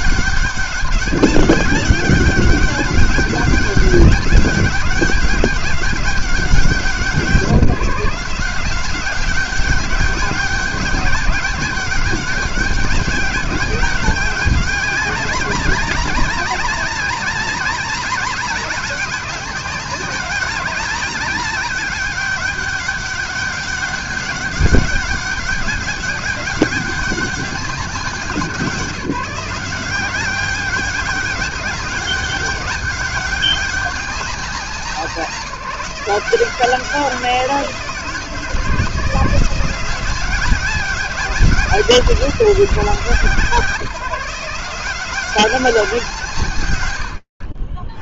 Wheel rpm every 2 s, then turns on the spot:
200, 200, 190, 170, 200, 200, 200, 200, 200, 190, 200, 200, 200, 180, 180, 200, 200, 180, 170, 180, 190, 150, 160, 130.
none